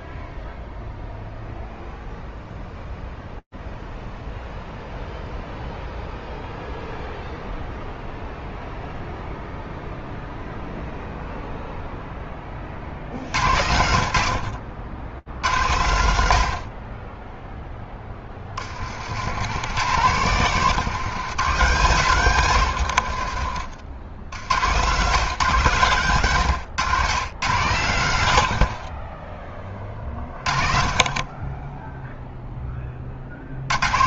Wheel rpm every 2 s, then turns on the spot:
0, 0, 0, 0, 0, 0, 0, 100, 120, 10, 120, 150, 60, 120, 120, 20, 30.
none